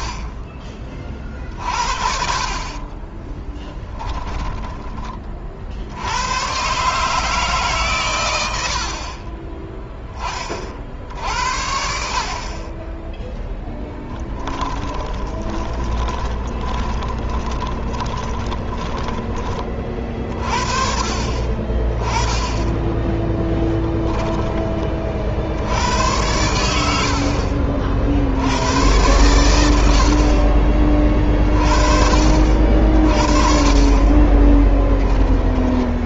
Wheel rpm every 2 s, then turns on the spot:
30, 30, 10, 130, 60, 50, 30, 20, 20, 20, 30, 10, 20, 90, 100, 30, 50, 10.
2-4 8-10 14-20 34-36